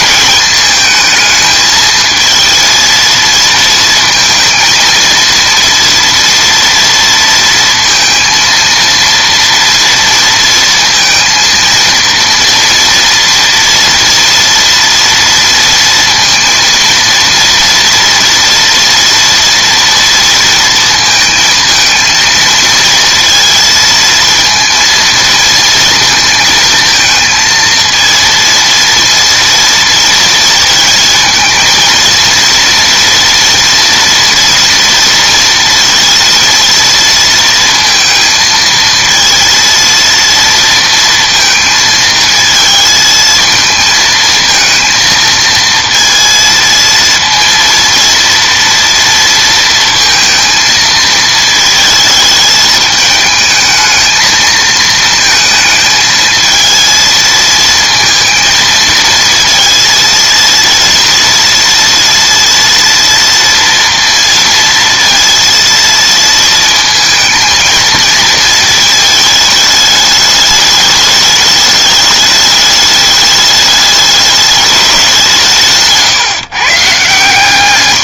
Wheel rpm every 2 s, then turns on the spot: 220, 230, 220, 230, 230, 230, 230, 230, 230, 230, 230, 230, 230, 220, 230, 220, 230, 230, 230, 230, 230, 220, 230, 230, 230, 230, 210, 220, 230, 230, 230, 230, 230, 220, 220, 210, 210, 200, 140.
none